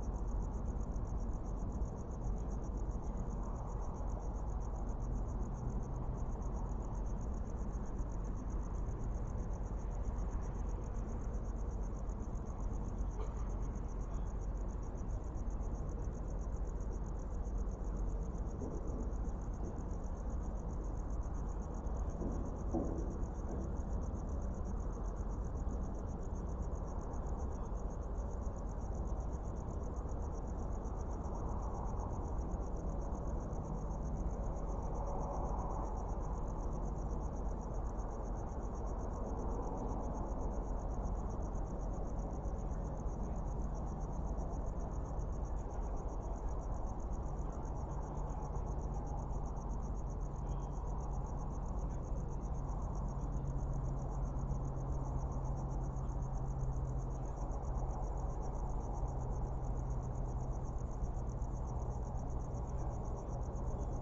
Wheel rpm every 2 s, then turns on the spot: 0, 0, 0, 0, 0, 0, 0, 0, 0, 0, 0, 0, 0, 0, 0, 0, 0, 0, 0, 0, 0, 0, 0, 0, 0, 0, 0, 0, 0, 0, 0, 0.
none